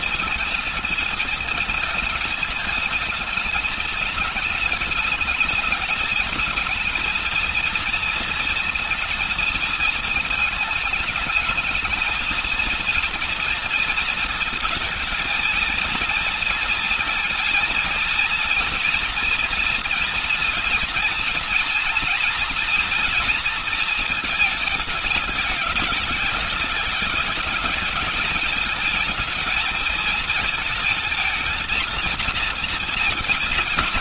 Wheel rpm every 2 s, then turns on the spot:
220, 220, 220, 230, 230, 220, 230, 230, 230, 230, 230, 240, 220, 210, 220, 220, 230.
none